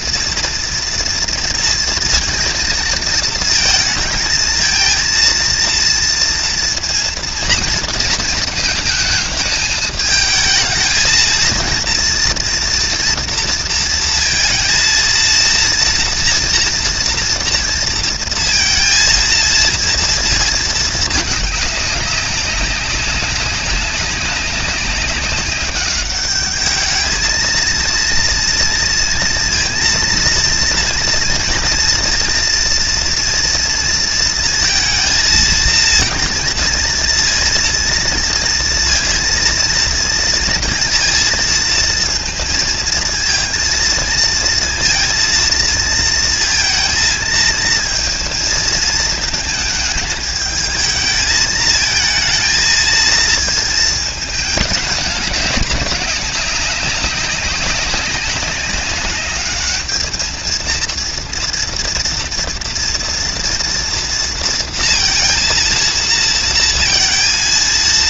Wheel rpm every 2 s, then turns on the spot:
230, 230, 230, 230, 220, 220, 230, 230, 230, 230, 230, 200, 200, 210, 230, 230, 230, 230, 230, 230, 230, 220, 230, 230, 220, 220, 230, 220, 190, 200, 220, 230, 230, 230.
none